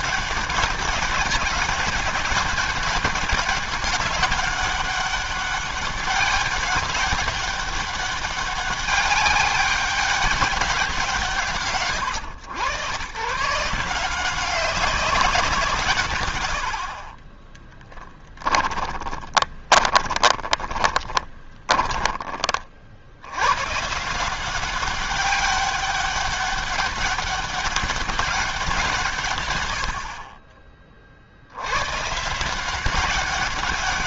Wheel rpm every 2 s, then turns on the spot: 200, 200, 200, 200, 190, 180, 110, 190, 50, 20, 30, 60, 200, 200, 160, 60, 190.
16-22